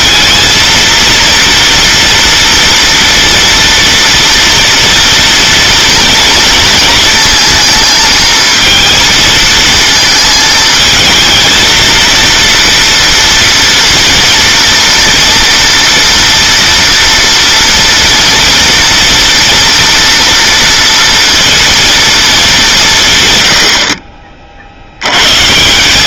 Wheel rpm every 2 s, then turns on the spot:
230, 230, 230, 230, 230, 220, 230, 230, 230, 230, 230, 190, 60.
none